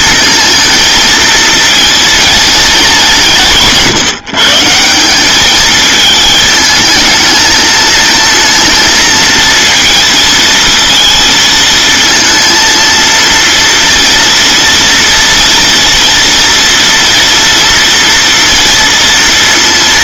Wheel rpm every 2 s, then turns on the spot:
220, 210, 170, 220, 230, 220, 230, 230, 230, 230.
none